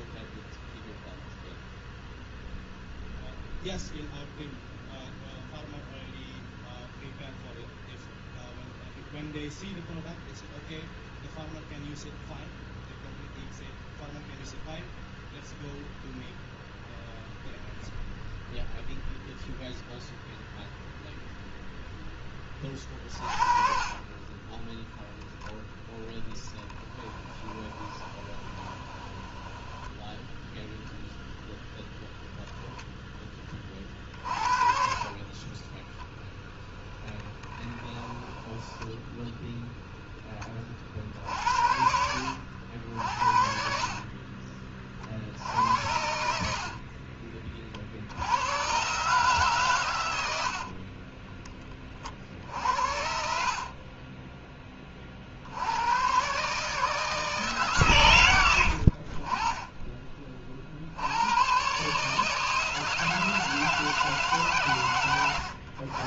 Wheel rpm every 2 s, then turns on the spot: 0, 0, 0, 0, 0, 0, 0, 0, 0, 0, 0, 30, 10, 10, 20, 0, 10, 40, 0, 10, 40, 80, 40, 60, 120, 60, 70, 20, 150, 80, 60, 160, 140.
26-30 38-40 46-48 50-52